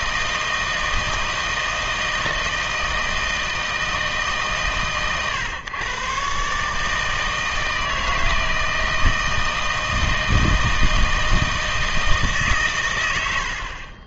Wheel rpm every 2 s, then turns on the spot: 160, 160, 140, 140, 160, 160, 130.
none